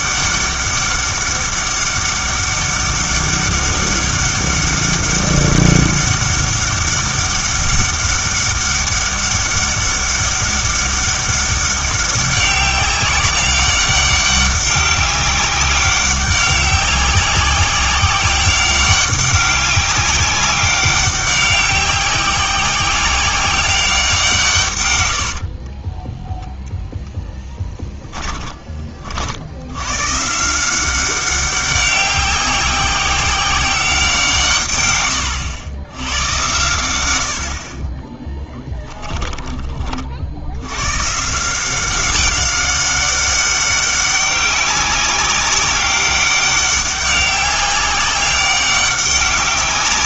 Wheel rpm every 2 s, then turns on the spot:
200, 200, 200, 200, 200, 200, 190, 190, 190, 200, 190, 190, 140, 0, 30, 170, 190, 130, 110, 10, 90, 190, 200, 200, 190.
38-40